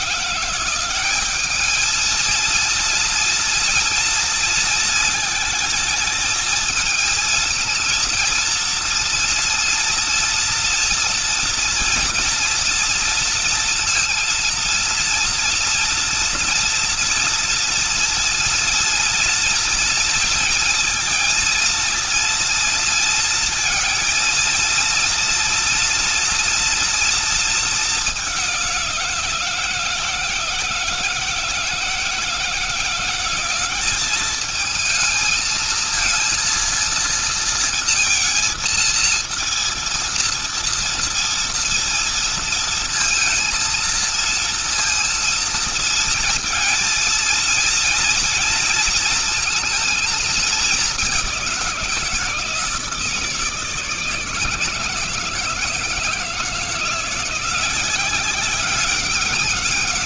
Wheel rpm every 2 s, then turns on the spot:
180, 230, 230, 220, 230, 230, 230, 230, 230, 230, 230, 230, 230, 230, 190, 160, 170, 220, 230, 230, 230, 230, 230, 220, 220, 200, 160, 160, 170, 190.
none